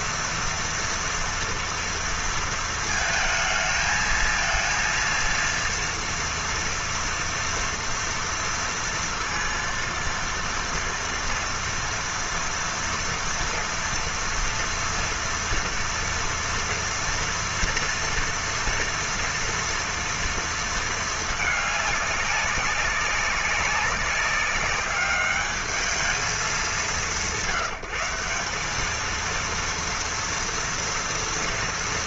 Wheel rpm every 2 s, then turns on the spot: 240, 230, 230, 230, 230, 230, 230, 230, 230, 230, 230, 200, 200, 190, 200, 240.
none